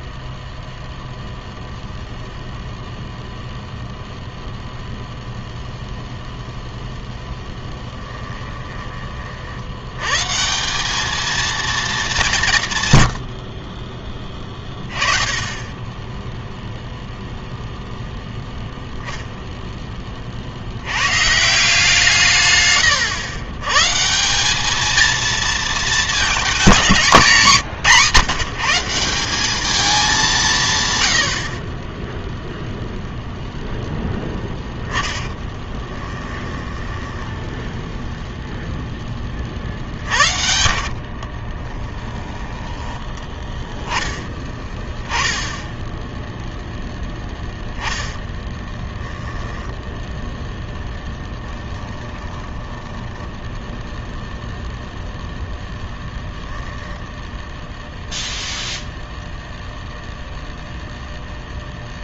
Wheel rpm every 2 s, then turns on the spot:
0, 10, 10, 0, 20, 190, 160, 20, 0, 0, 90, 110, 210, 220, 170, 130, 0, 10, 10, 20, 50, 20, 10, 0, 10, 10, 10, 0, 0, 0, 0.
34-38 40-42 48-50 52-54